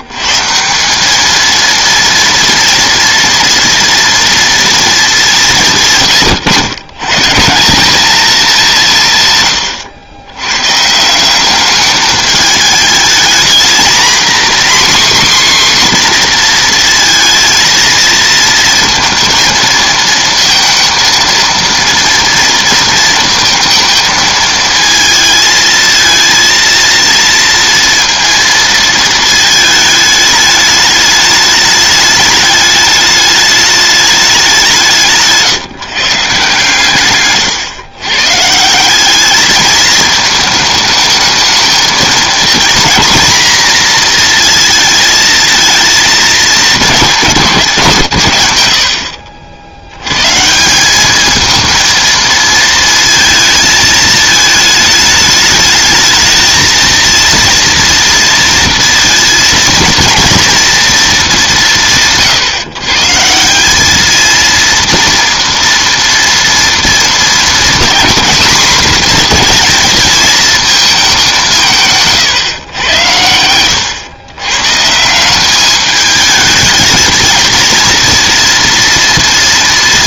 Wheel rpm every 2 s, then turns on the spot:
120, 230, 230, 120, 210, 120, 210, 250, 250, 230, 230, 230, 220, 230, 230, 210, 210, 190, 150, 140, 220, 220, 230, 220, 140, 150, 220, 220, 220, 230, 230, 130, 230, 230, 240, 220, 120, 140, 220, 240.
none